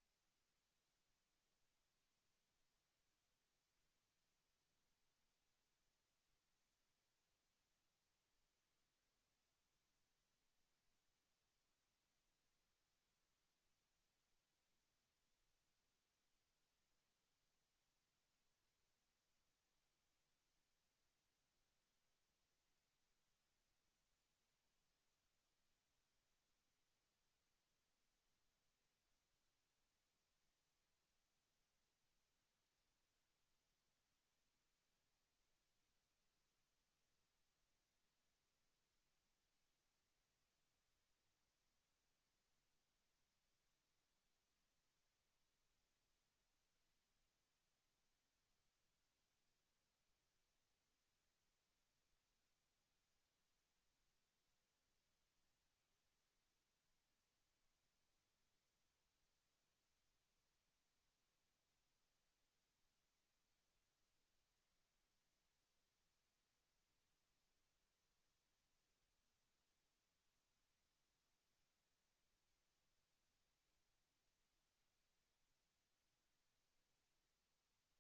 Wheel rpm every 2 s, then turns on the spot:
0, 0, 0, 0, 0, 0, 0, 0, 0, 0, 0, 0, 0, 0, 0, 0, 0, 0, 0, 0, 0, 0, 0, 0, 0, 0, 0, 0, 0, 0, 0, 0, 0, 0, 0, 0, 0, 0, 0.
none